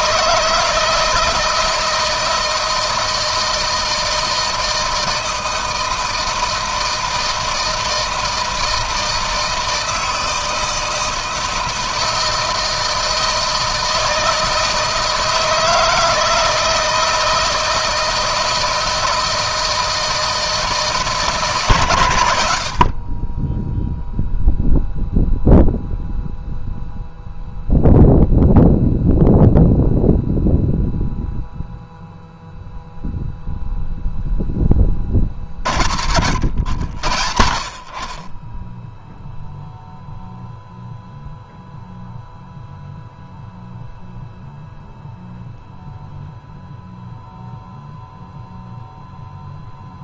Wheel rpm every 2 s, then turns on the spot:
160, 160, 160, 160, 160, 160, 160, 160, 160, 160, 160, 60, 0, 0, 0, 0, 0, 20, 70, 10, 0, 0, 0, 0, 0.
none